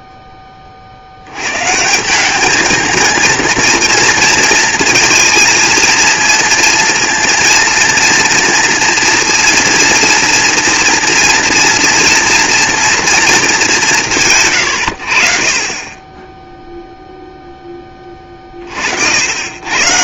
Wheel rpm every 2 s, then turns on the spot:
40, 220, 230, 230, 230, 230, 230, 100, 0, 50.
none